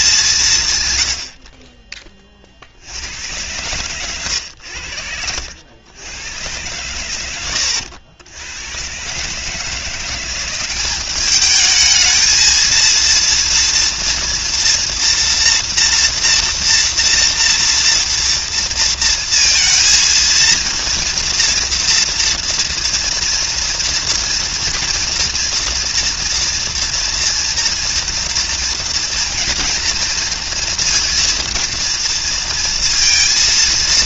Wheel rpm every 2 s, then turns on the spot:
150, 60, 80, 110, 100, 190, 230, 240, 240, 230, 230, 230, 230, 230, 230, 230, 230.
none